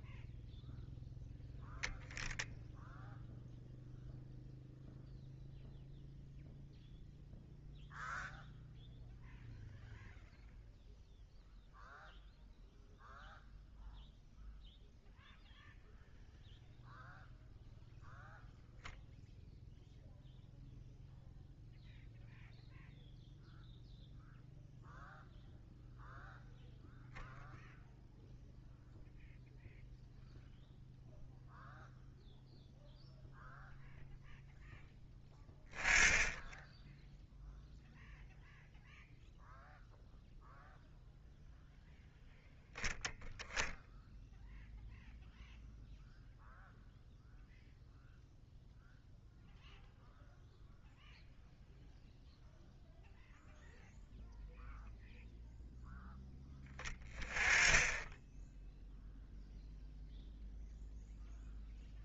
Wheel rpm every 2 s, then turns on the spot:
10, 0, 0, 0, 0, 0, 0, 0, 0, 0, 0, 0, 0, 0, 0, 0, 0, 0, 0, 0, 0, 0, 0, 0, 0, 0, 0, 0, 10, 0, 0.
none